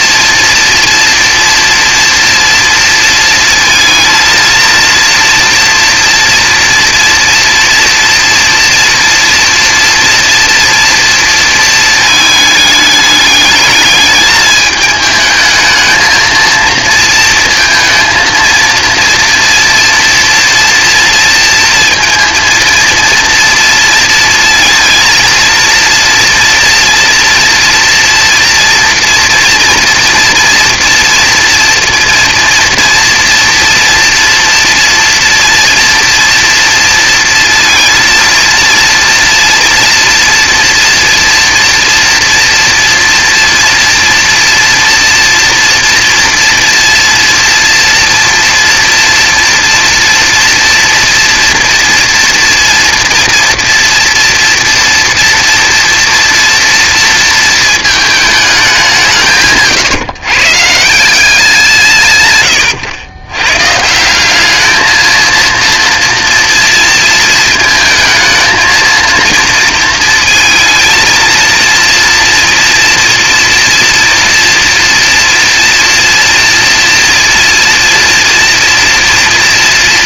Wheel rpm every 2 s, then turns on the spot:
240, 230, 230, 230, 230, 240, 210, 210, 230, 230, 230, 230, 230, 240, 230, 230, 230, 230, 230, 230, 230, 230, 230, 230, 230, 240, 230, 230, 230, 190, 150, 120, 210, 230, 220, 220, 230, 230, 230, 230.
none